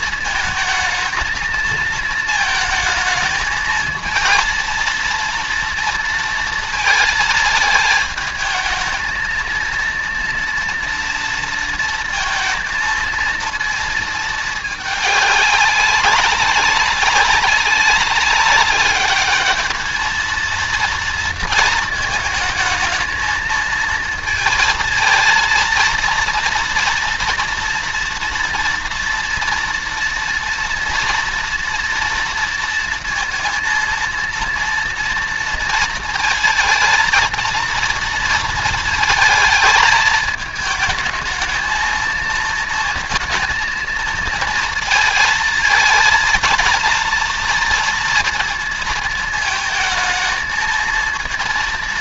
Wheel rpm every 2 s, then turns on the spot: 230, 220, 230, 220, 220, 230, 230, 210, 200, 210, 230, 220, 230, 230, 230, 230, 230, 230, 230, 230, 220, 230, 220, 230, 230, 230.
none